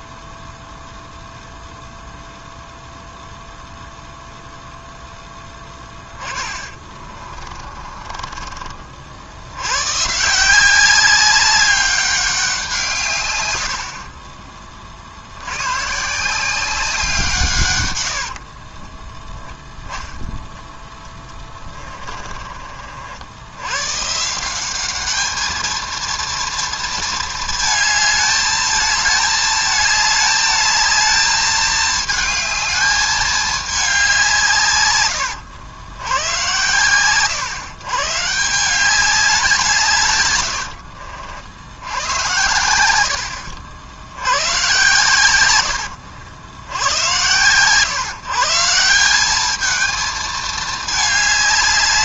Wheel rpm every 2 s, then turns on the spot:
0, 0, 0, 30, 40, 190, 160, 50, 180, 20, 20, 50, 200, 230, 220, 220, 210, 120, 120, 200, 60, 90, 120, 90, 180, 210.
6-8 20-22 40-42